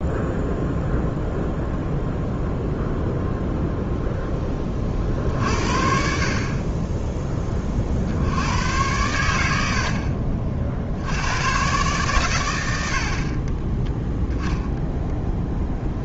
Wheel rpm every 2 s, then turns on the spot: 0, 0, 30, 20, 100, 80, 70, 10.
none